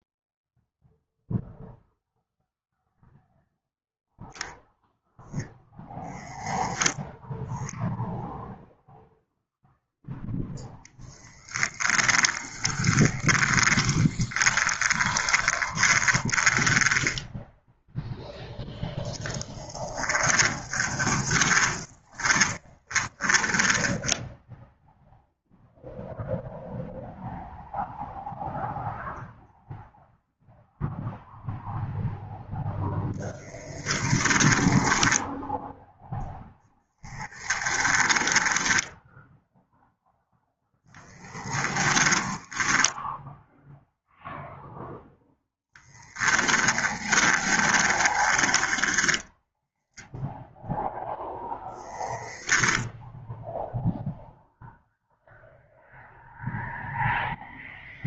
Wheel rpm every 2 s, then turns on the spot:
0, 0, 0, 10, 0, 10, 20, 30, 10, 20, 10, 20, 0, 0, 0, 0, 0, 0, 10, 10, 0, 0, 0, 10, 10, 0, 10, 0, 0.
12-18 20-24 36-38 46-50 52-54